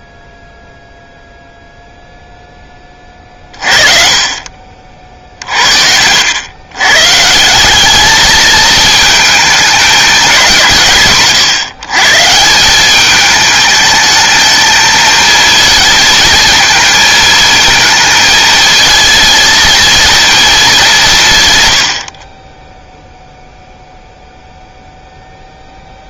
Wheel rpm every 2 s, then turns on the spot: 0, 20, 50, 120, 220, 170, 180, 220, 220, 220, 210, 10, 0.
none